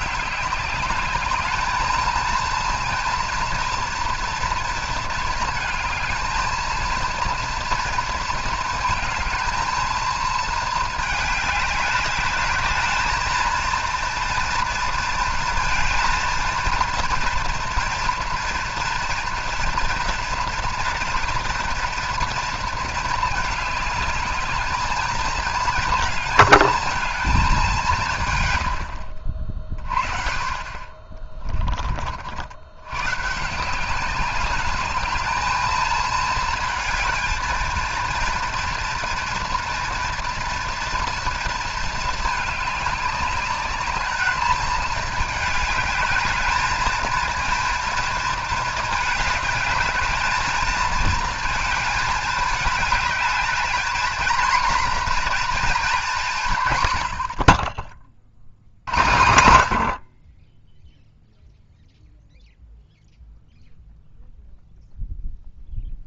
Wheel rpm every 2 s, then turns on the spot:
200, 230, 230, 220, 230, 220, 210, 230, 230, 240, 240, 230, 210, 230, 100, 30, 90, 200, 230, 230, 230, 210, 220, 220, 220, 210, 210, 240, 130, 80, 20, 0, 0.
none